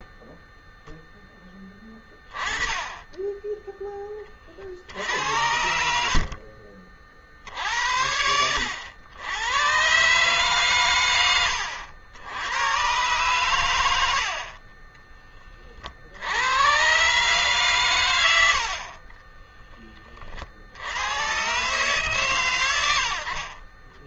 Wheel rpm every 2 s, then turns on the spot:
0, 20, 40, 50, 80, 140, 100, 40, 90, 90, 60, 110.
14-16